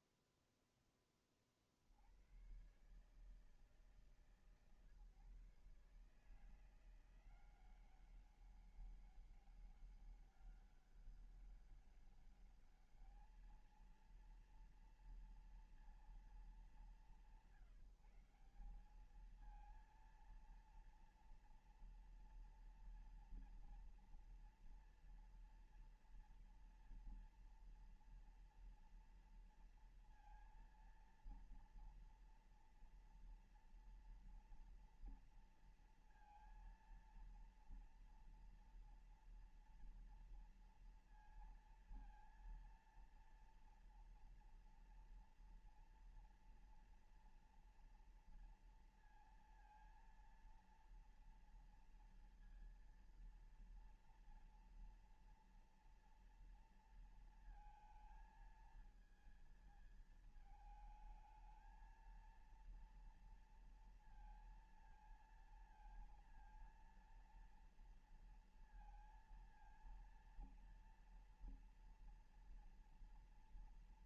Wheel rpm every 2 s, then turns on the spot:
0, 80, 160, 160, 190, 200, 200, 230, 220, 190, 230, 230, 230, 230, 230, 230, 230, 230, 230, 230, 230, 230, 230, 230, 230, 230, 240, 230, 230, 220, 220, 220, 230, 230, 230, 230, 230.
none